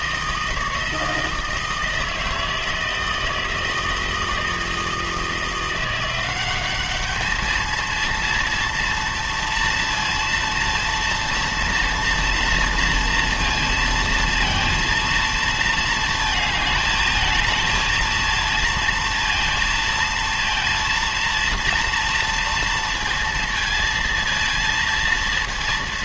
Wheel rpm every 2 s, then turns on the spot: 160, 160, 160, 200, 230, 230, 230, 230, 220, 230, 230, 230, 230.
none